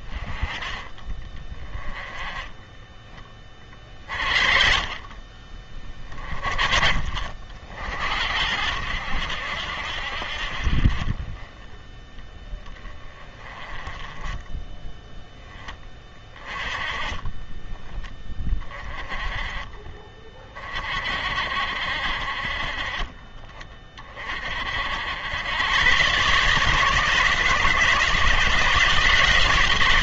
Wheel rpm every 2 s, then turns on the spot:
20, 10, 40, 40, 80, 40, 20, 10, 20, 20, 40, 30, 60, 150, 160.
none